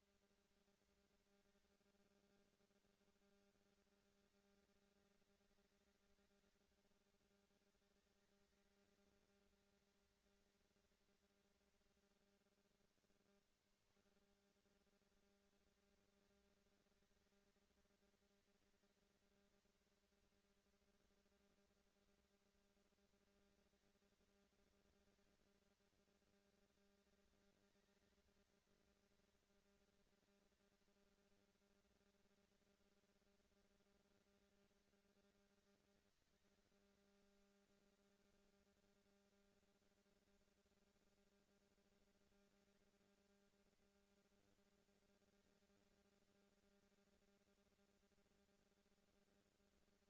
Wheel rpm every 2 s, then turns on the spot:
200, 90, 200, 200, 220, 220, 40, 210, 230, 230, 230, 230, 220, 220, 230, 230, 230, 220, 200, 220, 230, 230, 230, 230, 230.
12-14